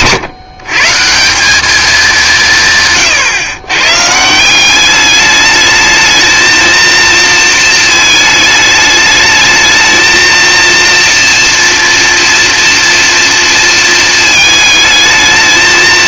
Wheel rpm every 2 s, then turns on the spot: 140, 140, 190, 230, 210, 230, 230, 220.
none